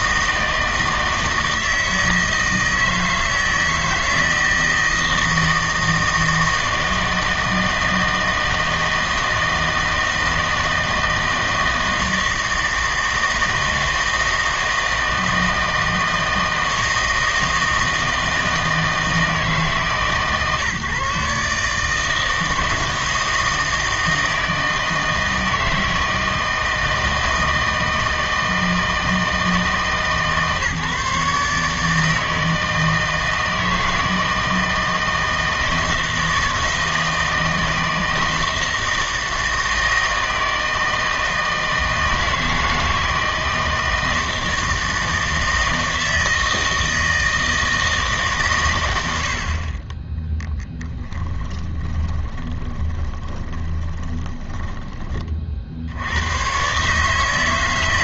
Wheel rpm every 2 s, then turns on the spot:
160, 160, 160, 160, 160, 160, 160, 160, 160, 160, 150, 160, 160, 160, 160, 150, 160, 160, 160, 160, 160, 160, 160, 160, 120, 10, 20, 20, 130.
52-56